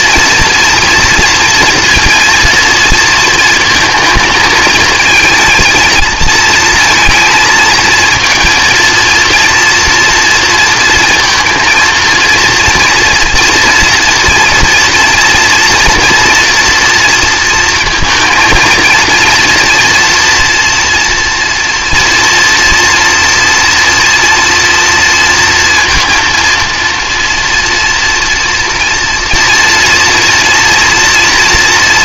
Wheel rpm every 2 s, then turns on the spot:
240, 230, 230, 230, 230, 230, 240, 230, 230, 230, 230, 230, 230, 230, 240, 230.
none